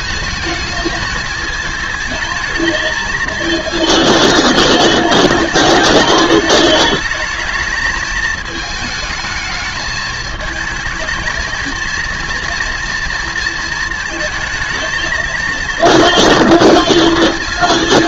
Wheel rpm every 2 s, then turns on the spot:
220, 220, 220, 210, 220, 220, 230, 220, 230.
none